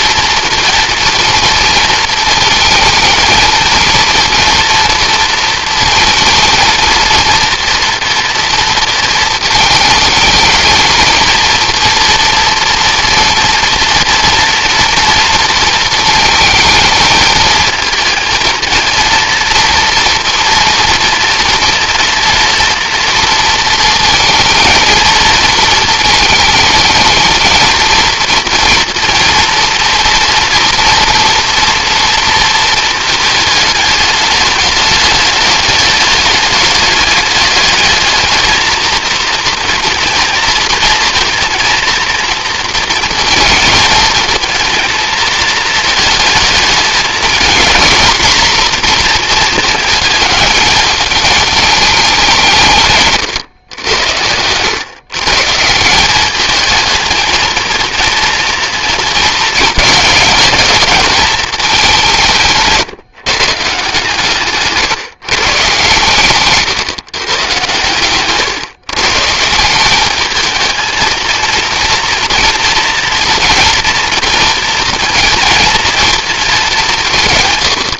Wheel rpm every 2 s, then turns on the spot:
230, 220, 230, 230, 230, 220, 240, 230, 220, 230, 230, 240, 220, 220, 230, 240, 230, 210, 210, 220, 230, 230, 220, 210, 230, 210, 160, 110, 220, 230, 210, 150, 140, 140, 140, 220, 230, 230, 200.
64-66